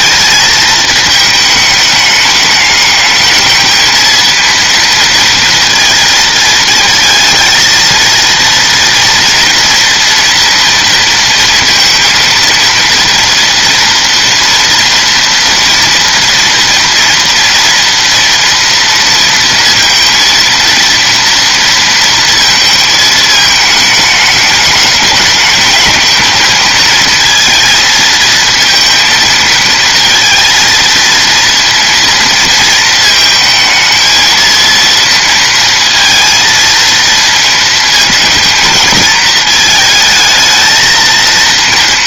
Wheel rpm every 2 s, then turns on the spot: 220, 210, 230, 220, 230, 230, 230, 230, 230, 230, 230, 220, 210, 220, 230, 230, 230, 230, 230, 220, 220.
none